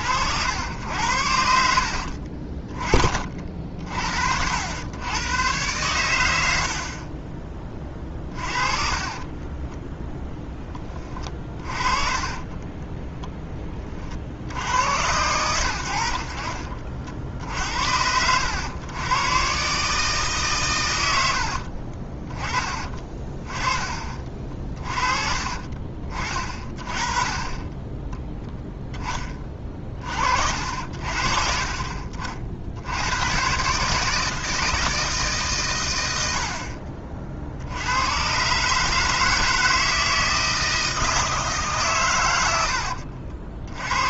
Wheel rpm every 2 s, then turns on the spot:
80, 30, 100, 40, 30, 10, 10, 90, 50, 100, 120, 30, 30, 30, 10, 50, 80, 160, 50, 150, 160, 80.
8-10 12-14 22-24